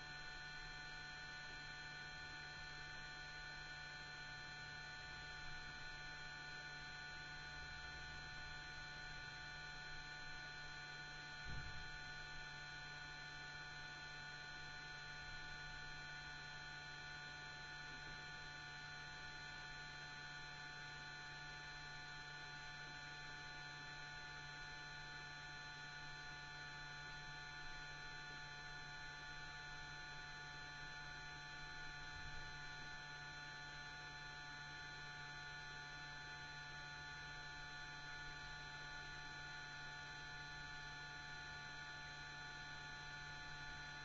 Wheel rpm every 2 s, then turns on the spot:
0, 0, 0, 0, 0, 0, 0, 0, 0, 0, 0, 0, 0, 0, 0, 0, 0, 0, 0, 0, 0, 0.
none